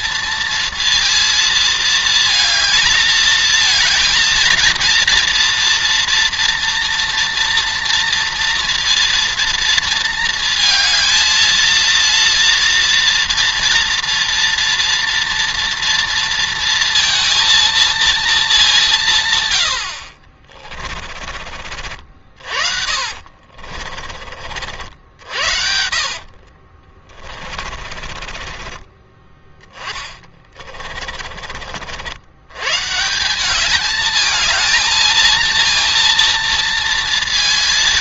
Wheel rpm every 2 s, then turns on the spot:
230, 220, 230, 230, 230, 230, 230, 230, 230, 200, 40, 50, 50, 40, 30, 30, 120, 220, 230.
20-24 26-32